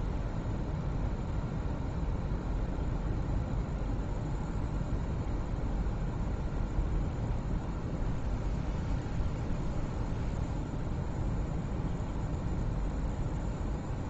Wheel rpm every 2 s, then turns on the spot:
0, 0, 0, 0, 0, 0, 0.
none